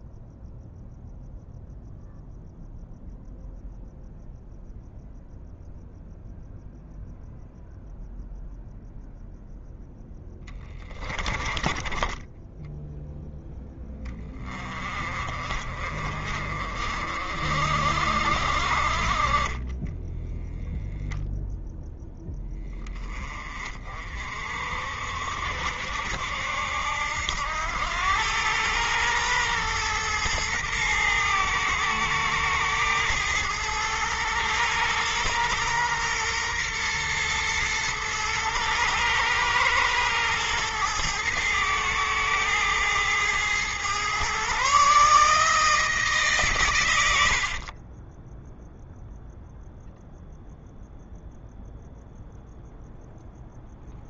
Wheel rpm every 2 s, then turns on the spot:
0, 0, 0, 0, 0, 20, 10, 40, 40, 50, 0, 20, 50, 70, 110, 110, 110, 110, 120, 110, 110, 110, 140, 120, 0, 0, 0.
none